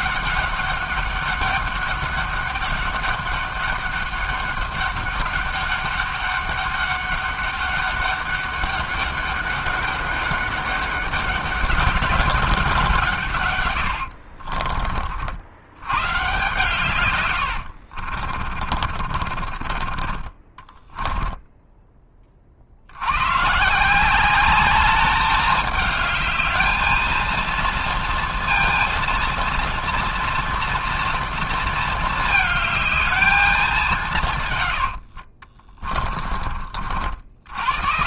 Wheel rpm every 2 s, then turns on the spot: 200, 200, 200, 200, 200, 200, 190, 50, 130, 30, 10, 50, 200, 220, 230, 240, 220, 110, 50.
14-16 18-20 34-36